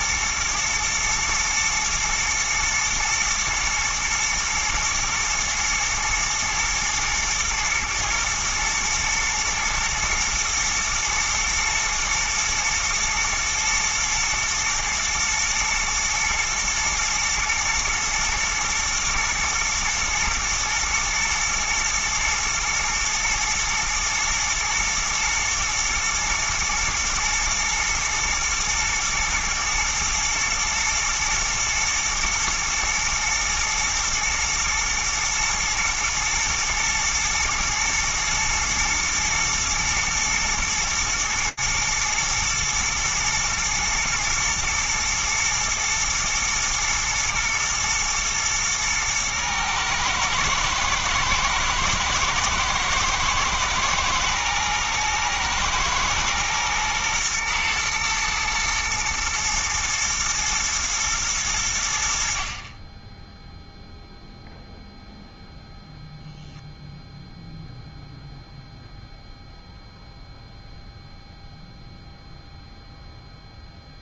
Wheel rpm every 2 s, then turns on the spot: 120, 110, 110, 110, 110, 120, 120, 120, 120, 110, 120, 120, 110, 120, 110, 110, 110, 120, 120, 110, 110, 110, 120, 110, 120, 110, 110, 110, 110, 110, 120, 30, 0, 0, 0, 0, 0.
none